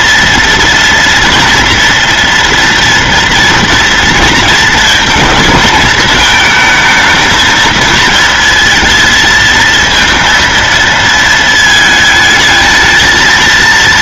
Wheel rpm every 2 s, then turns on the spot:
230, 230, 230, 220, 230, 230, 220.
none